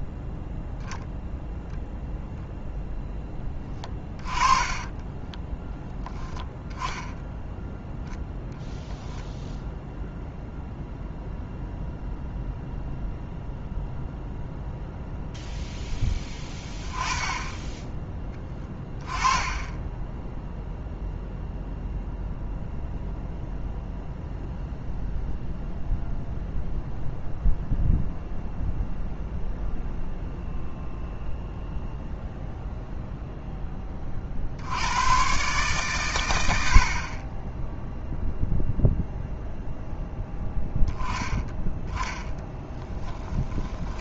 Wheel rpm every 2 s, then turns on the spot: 0, 0, 20, 10, 0, 0, 0, 0, 10, 10, 0, 0, 0, 0, 0, 0, 0, 90, 60, 0, 10, 10.
4-6 16-20